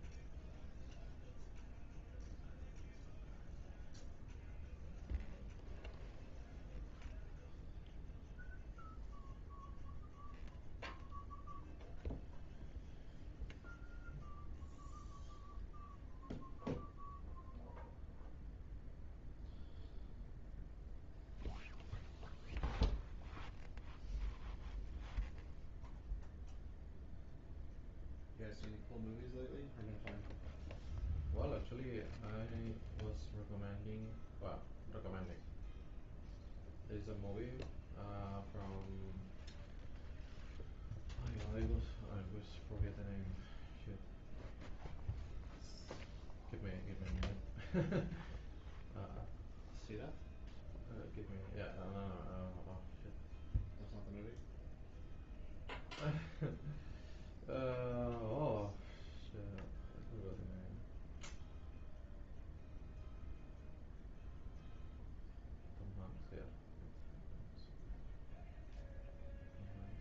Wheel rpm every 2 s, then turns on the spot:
0, 0, 0, 0, 0, 0, 0, 0, 0, 0, 0, 0, 0, 0, 0, 0, 0, 0, 0, 0, 0, 0, 0, 0, 0, 0, 0, 0, 0, 0, 0, 0, 0, 0, 0.
none